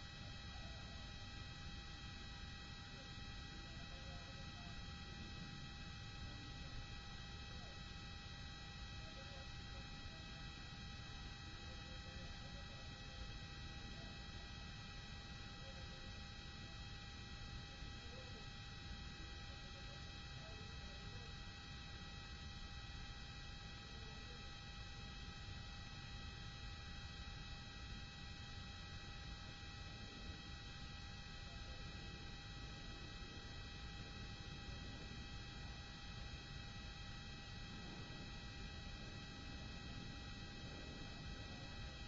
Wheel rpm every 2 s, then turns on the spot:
0, 0, 0, 0, 0, 0, 0, 0, 0, 0, 0, 0, 0, 0, 0, 0, 0, 0, 0, 0, 0.
none